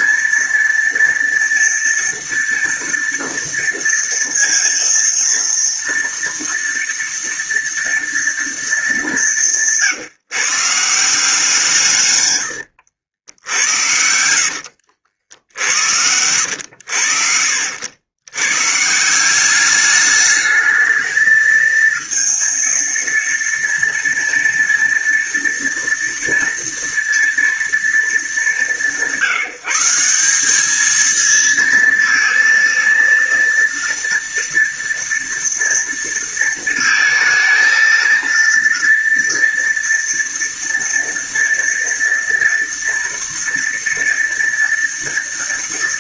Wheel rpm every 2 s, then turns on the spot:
230, 230, 230, 230, 200, 160, 80, 70, 80, 150, 210, 230, 230, 230, 180, 220, 230, 230, 230, 230, 230, 230, 230.
12-16